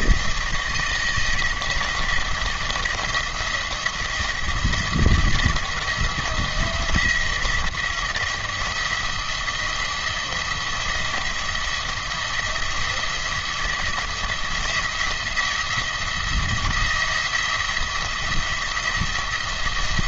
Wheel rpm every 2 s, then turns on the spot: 160, 170, 160, 170, 170, 170, 170, 170, 170, 170.
none